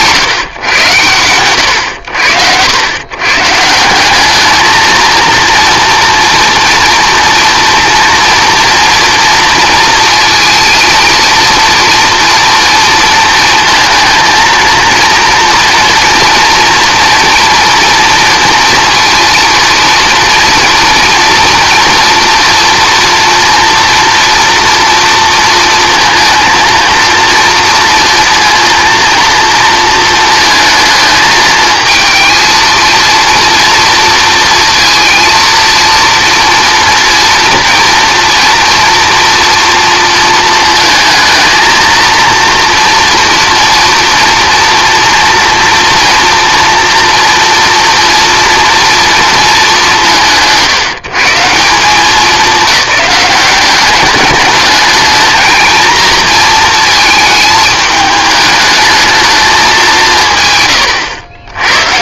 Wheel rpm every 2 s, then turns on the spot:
120, 100, 230, 230, 230, 230, 230, 230, 230, 230, 230, 240, 230, 230, 230, 220, 220, 230, 230, 230, 220, 230, 230, 240, 230, 120, 190, 210, 220, 210, 130.
none